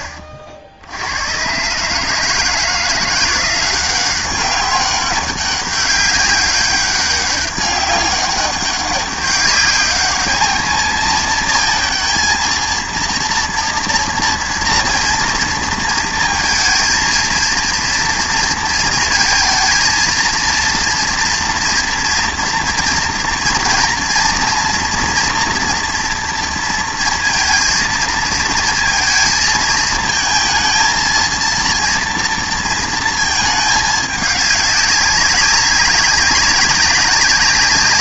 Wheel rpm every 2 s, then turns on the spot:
70, 160, 190, 200, 200, 220, 230, 230, 230, 230, 230, 230, 230, 230, 230, 220, 230, 200, 190.
none